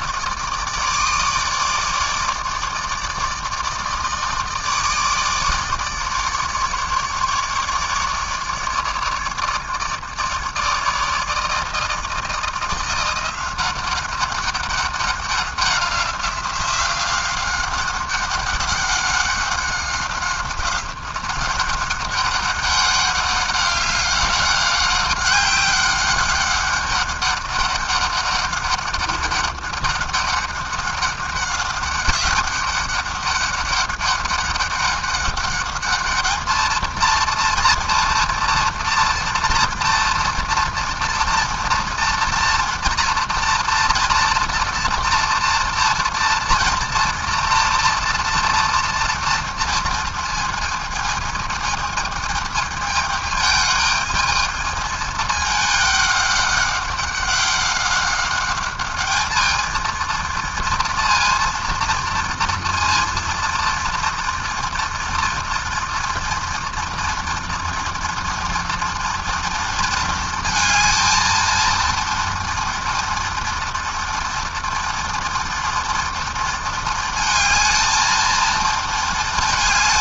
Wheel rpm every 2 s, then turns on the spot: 160, 150, 160, 150, 150, 150, 170, 200, 180, 190, 190, 200, 200, 200, 200, 200, 200, 200, 220, 230, 230, 240, 230, 230, 230, 220, 220, 220, 200, 200, 230, 230, 230, 240, 230, 230, 230, 240, 230, 230.
none